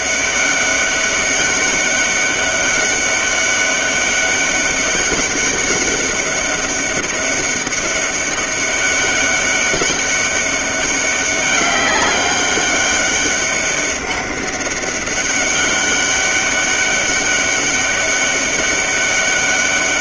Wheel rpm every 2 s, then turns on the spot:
200, 200, 200, 200, 200, 200, 190, 200, 200, 200.
none